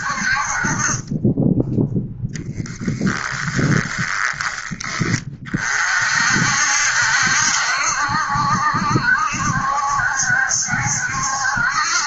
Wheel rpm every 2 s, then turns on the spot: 30, 10, 20, 70, 70, 70.
2-4